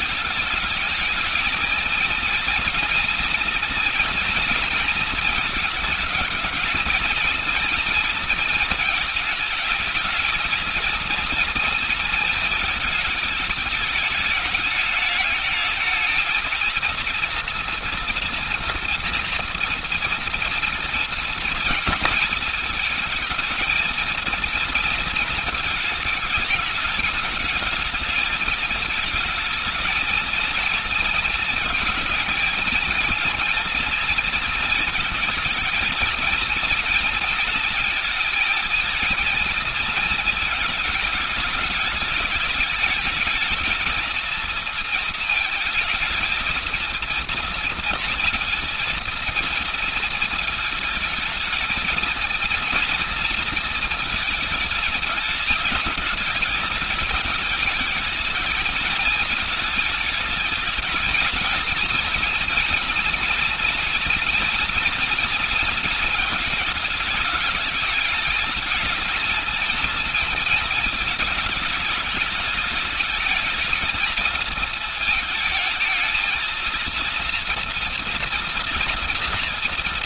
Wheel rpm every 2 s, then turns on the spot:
220, 230, 230, 230, 220, 220, 230, 210, 230, 230, 230, 220, 230, 210, 220, 230, 230, 220, 230, 230, 220, 210, 220, 230, 230, 220, 230, 220, 210, 220, 220, 230, 230, 220, 230, 230, 210, 220, 230, 230.
none